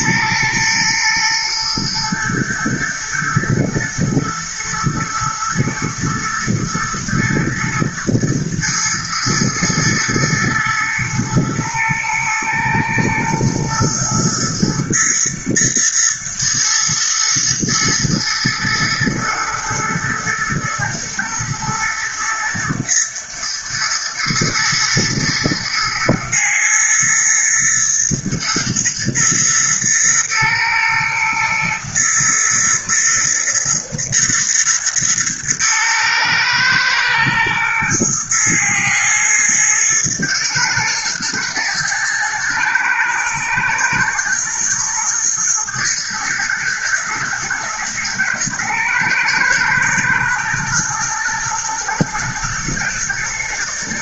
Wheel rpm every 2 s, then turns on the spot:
110, 120, 120, 110, 110, 110, 110, 110, 110, 110, 110, 110, 110, 110, 110, 110, 120, 110, 110, 110, 110, 120, 110, 120, 120, 110, 110.
none